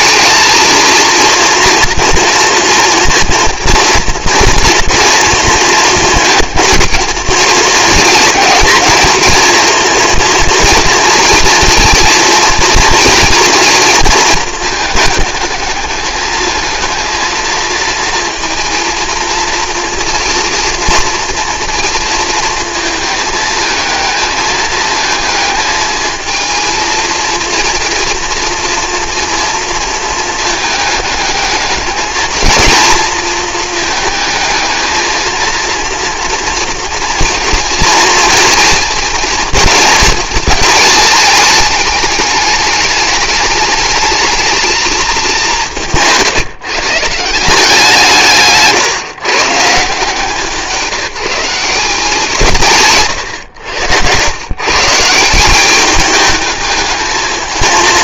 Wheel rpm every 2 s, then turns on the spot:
230, 230, 230, 230, 230, 230, 230, 220, 220, 230, 230, 220, 220, 220, 230, 220, 220, 220, 230, 230, 220, 210, 230, 150, 140, 160, 160, 120, 220.
none